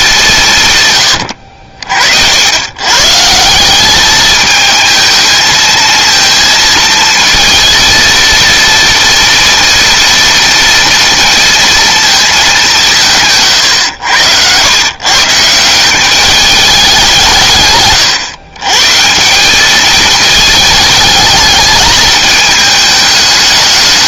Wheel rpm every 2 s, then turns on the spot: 180, 80, 210, 230, 230, 230, 220, 100, 200, 120, 220, 220.
none